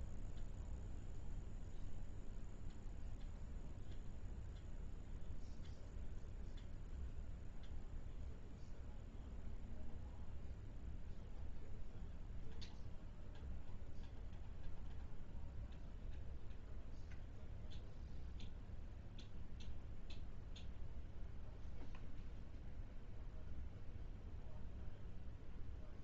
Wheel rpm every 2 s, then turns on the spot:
0, 0, 0, 0, 0, 0, 0, 0, 0, 0, 0, 0, 0.
none